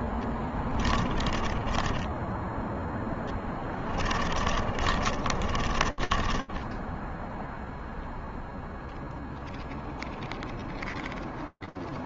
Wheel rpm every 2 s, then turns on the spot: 10, 10, 40, 10, 0, 0.
2-8